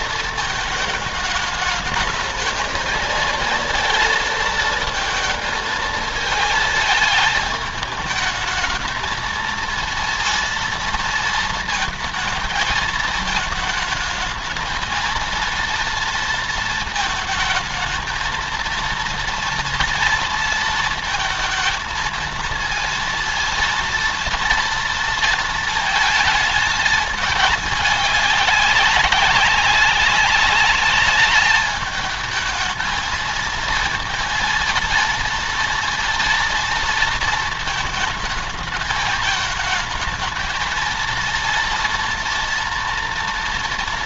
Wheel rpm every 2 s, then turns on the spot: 220, 220, 230, 220, 210, 230, 220, 220, 230, 220, 230, 230, 230, 220, 200, 200, 220, 230, 230, 220, 220, 240.
none